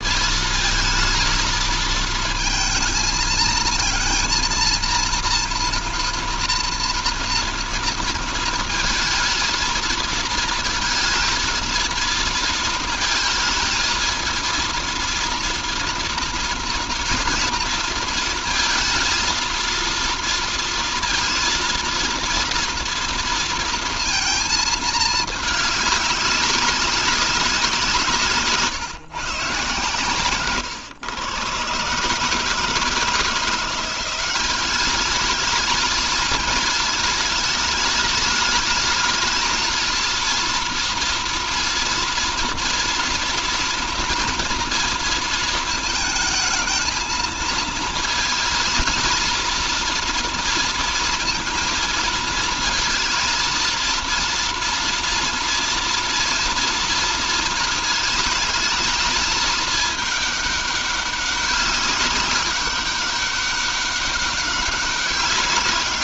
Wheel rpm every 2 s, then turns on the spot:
220, 220, 230, 240, 230, 230, 230, 230, 230, 230, 230, 230, 220, 190, 150, 130, 160, 200, 220, 220, 230, 230, 230, 220, 220, 230, 220, 230, 230, 220, 200, 200, 200.
none